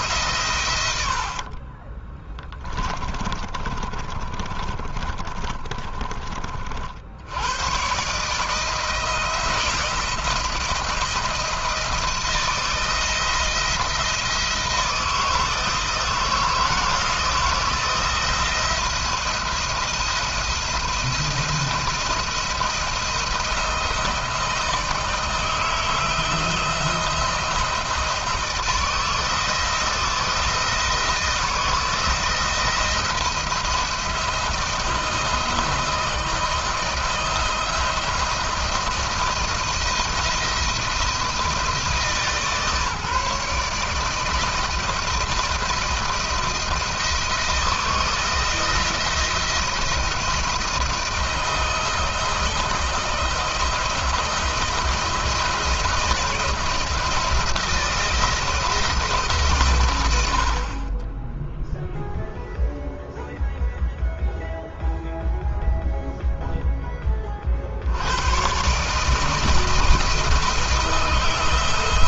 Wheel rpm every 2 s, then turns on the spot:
130, 20, 30, 50, 160, 170, 170, 170, 160, 170, 170, 170, 160, 170, 160, 170, 170, 170, 160, 170, 170, 150, 160, 170, 170, 170, 170, 170, 170, 170, 50, 0, 0, 10, 130, 160.
2-6